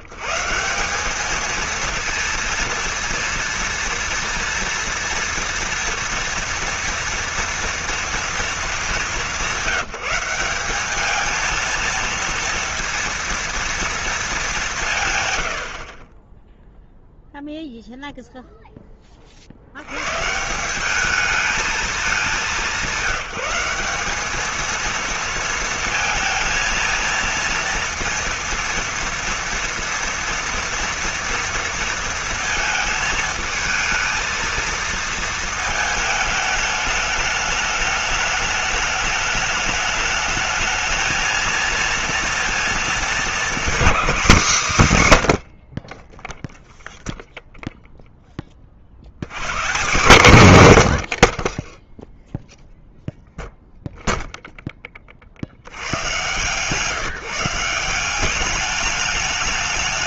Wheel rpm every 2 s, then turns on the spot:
140, 230, 230, 230, 230, 190, 230, 200, 10, 0, 150, 190, 210, 230, 230, 230, 230, 230, 210, 210, 220, 230, 210, 10, 20, 140, 0, 0, 130, 190.
none